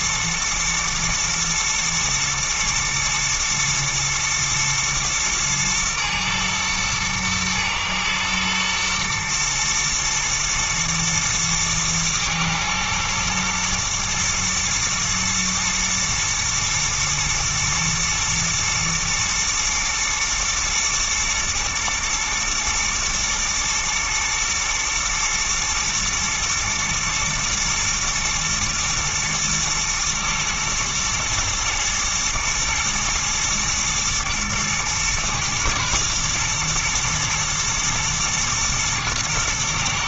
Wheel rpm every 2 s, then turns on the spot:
120, 120, 110, 110, 120, 110, 110, 110, 110, 120, 120, 110, 110, 110, 110, 110, 120, 120, 120, 110.
none